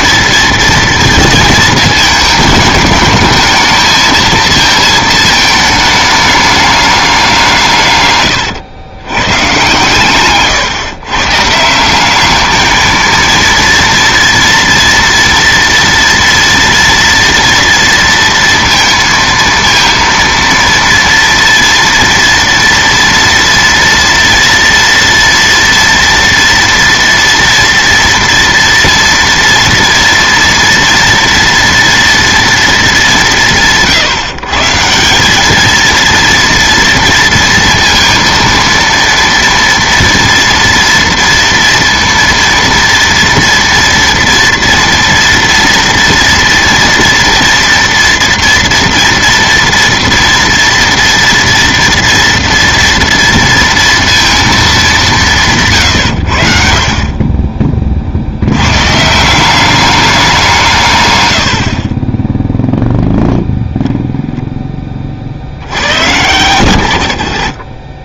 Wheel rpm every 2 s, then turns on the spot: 230, 220, 220, 210, 110, 130, 210, 230, 230, 230, 230, 230, 230, 230, 230, 230, 230, 150, 230, 230, 230, 230, 230, 230, 230, 230, 230, 220, 70, 90, 170, 0, 10, 100.
none